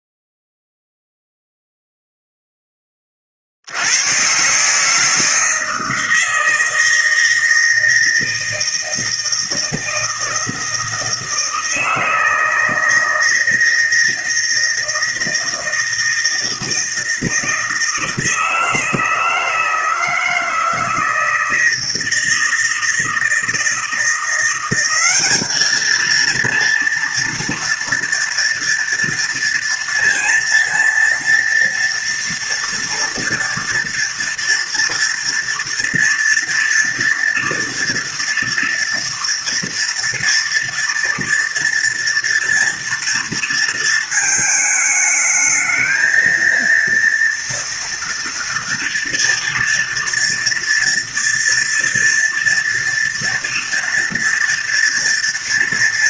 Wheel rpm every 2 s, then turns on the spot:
0, 10, 140, 160, 160, 160, 160, 160, 160, 160, 160, 160, 180, 230, 240, 230, 230, 230, 230, 240, 230, 230, 220, 230, 230, 230, 230, 230.
none